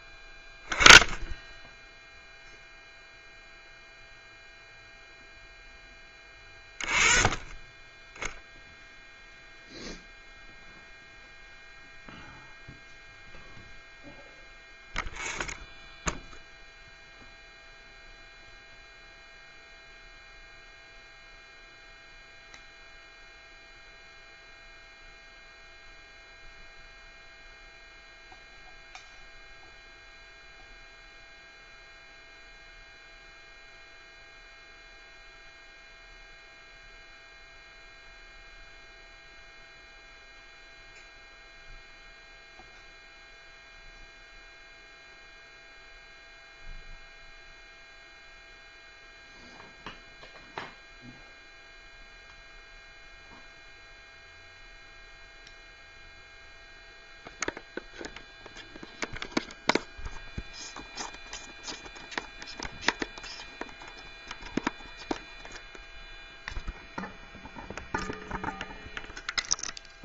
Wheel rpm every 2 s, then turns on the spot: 10, 0, 0, 20, 0, 0, 0, 0, 0, 0, 0, 0, 0, 0, 0, 0, 0, 0, 0, 0, 0, 0, 0, 0, 0, 0, 0, 0, 0, 0, 0, 0, 0, 0, 0.
none